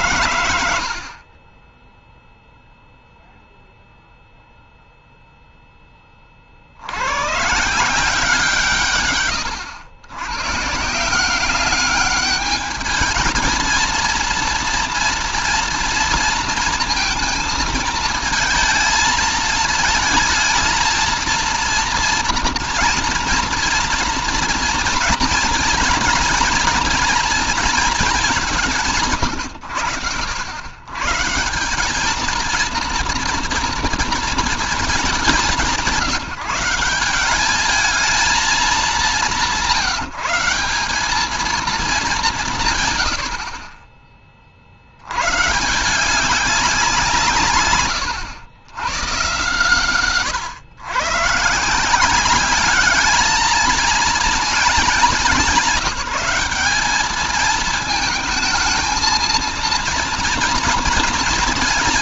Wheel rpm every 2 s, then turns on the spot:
110, 0, 0, 40, 160, 110, 210, 230, 230, 220, 220, 230, 240, 240, 210, 100, 220, 230, 170, 220, 180, 170, 40, 180, 100, 130, 190, 220, 200, 220, 230.
none